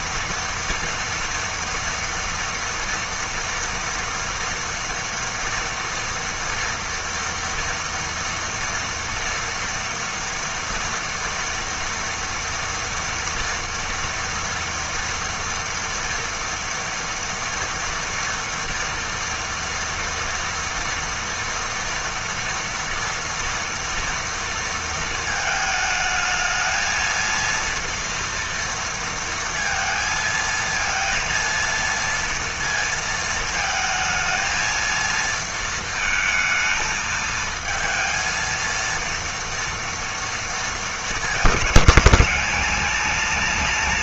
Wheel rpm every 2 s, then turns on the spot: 230, 230, 230, 230, 230, 230, 230, 230, 230, 230, 230, 230, 230, 220, 230, 230, 230, 220, 220, 230, 220, 210.
none